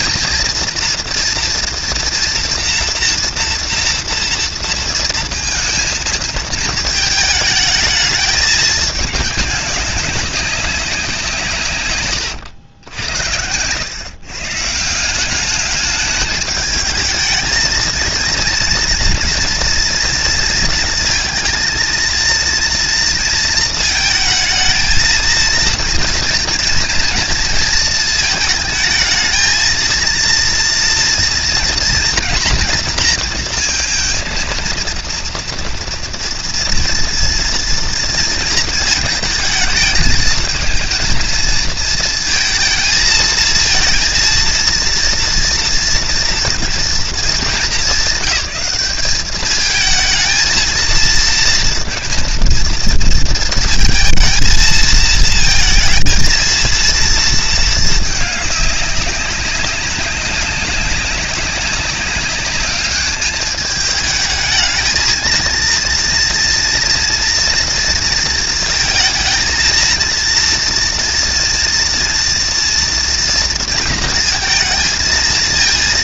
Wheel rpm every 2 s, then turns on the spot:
230, 230, 230, 220, 200, 180, 90, 170, 220, 240, 230, 230, 220, 230, 220, 230, 230, 230, 230, 220, 220, 220, 230, 230, 210, 230, 230, 230, 230, 200, 190, 200, 220, 230, 230, 230, 230, 220.
none